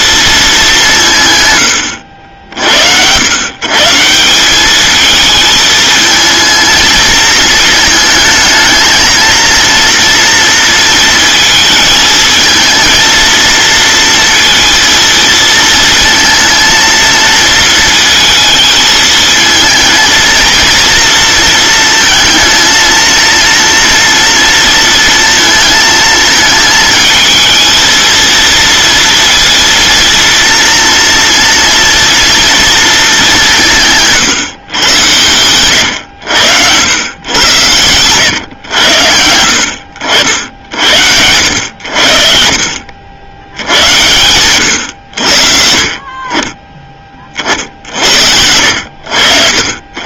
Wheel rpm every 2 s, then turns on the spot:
190, 80, 200, 220, 220, 230, 220, 230, 230, 220, 230, 230, 230, 220, 230, 230, 230, 120, 110, 100, 70, 60, 110, 20, 80.
none